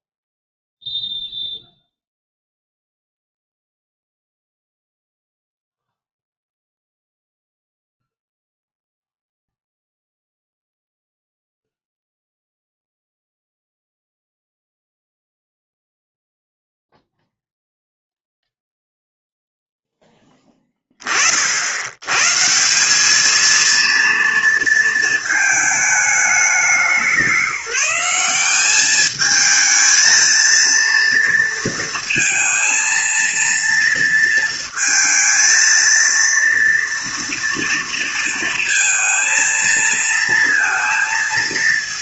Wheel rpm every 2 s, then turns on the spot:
0, 0, 0, 0, 0, 0, 0, 0, 0, 0, 20, 180, 230, 190, 200, 230, 230, 230, 230, 230, 230.
none